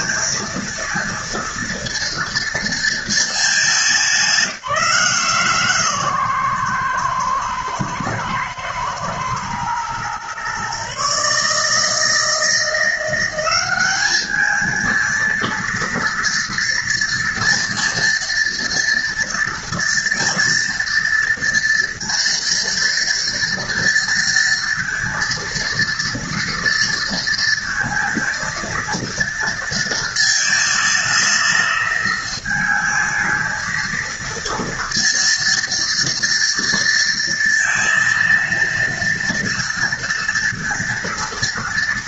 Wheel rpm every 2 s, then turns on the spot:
230, 230, 170, 120, 110, 130, 170, 220, 230, 230, 230, 230, 230, 230, 230, 220, 220, 230, 230, 230, 230.
none